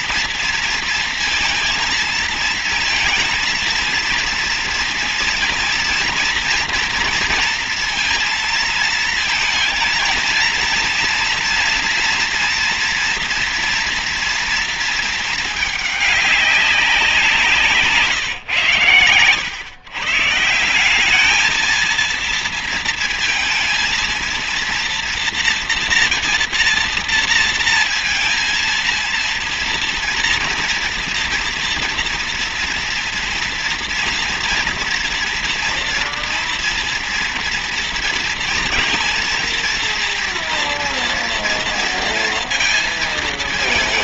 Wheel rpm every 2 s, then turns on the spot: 230, 230, 230, 230, 230, 230, 230, 230, 200, 130, 170, 230, 230, 230, 230, 230, 230, 230, 230, 230, 230, 230.
none